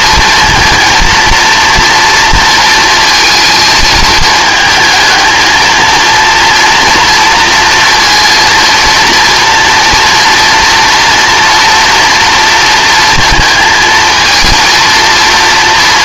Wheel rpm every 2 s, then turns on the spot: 230, 230, 220, 230, 230, 240, 230, 230.
none